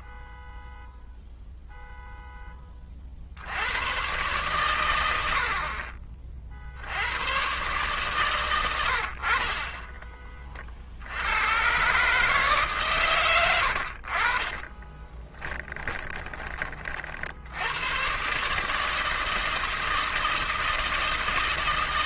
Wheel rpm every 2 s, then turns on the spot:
0, 100, 60, 120, 20, 140, 50, 20, 110, 160, 160.
14-16